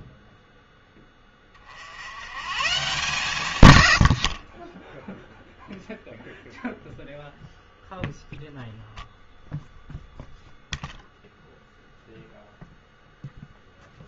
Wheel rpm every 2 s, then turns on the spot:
10, 160, 20, 0, 0, 0, 0.
4-6